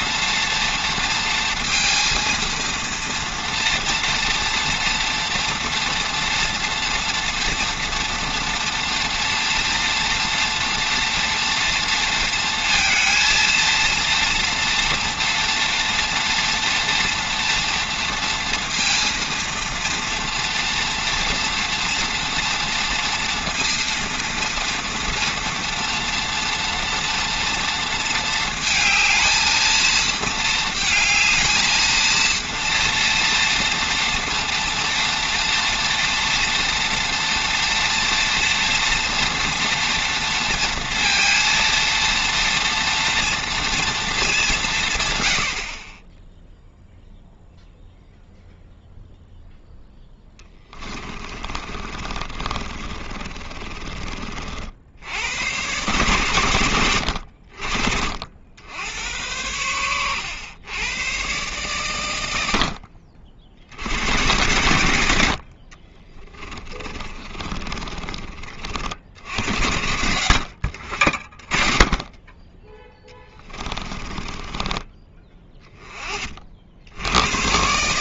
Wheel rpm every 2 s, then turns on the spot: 230, 230, 230, 230, 230, 230, 220, 240, 230, 230, 230, 230, 230, 230, 220, 230, 230, 230, 230, 230, 230, 230, 170, 0, 0, 20, 30, 60, 110, 80, 100, 80, 110, 30, 40, 70, 10, 20, 60.
50-54 66-68 74-76